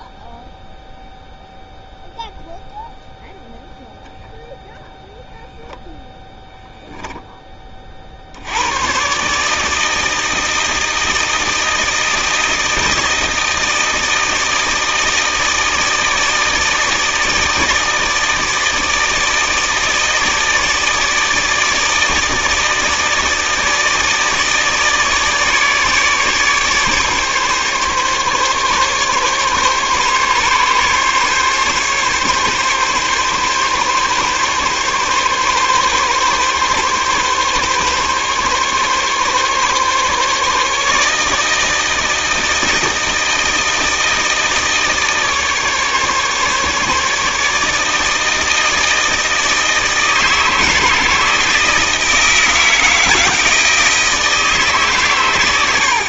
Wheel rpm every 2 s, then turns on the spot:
0, 0, 0, 10, 120, 160, 160, 160, 160, 160, 160, 160, 150, 150, 140, 140, 140, 140, 140, 140, 150, 160, 160, 150, 160, 160, 160, 140.
6-8